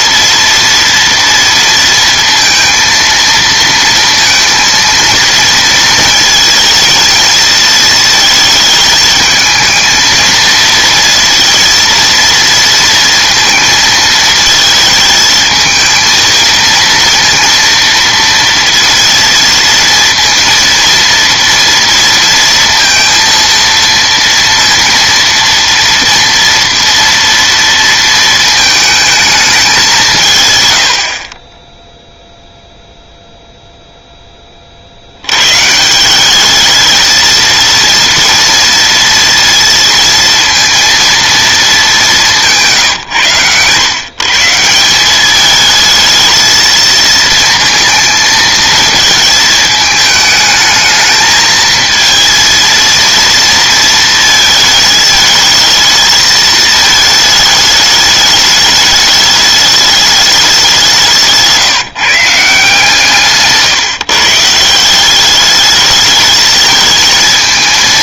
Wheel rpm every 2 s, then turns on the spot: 230, 230, 230, 220, 220, 230, 230, 220, 230, 230, 230, 230, 230, 230, 220, 120, 0, 30, 210, 230, 230, 160, 170, 220, 230, 220, 230, 220, 220, 210, 190, 160, 160, 220.
none